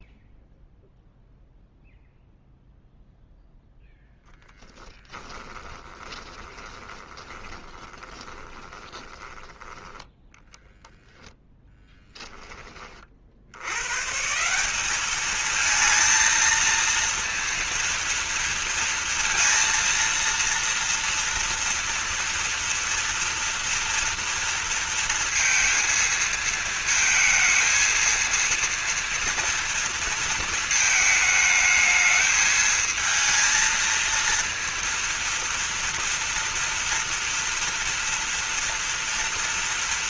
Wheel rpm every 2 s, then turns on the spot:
0, 0, 10, 20, 20, 0, 20, 180, 230, 230, 230, 230, 230, 230, 230, 220, 220, 230, 240, 230.
4-10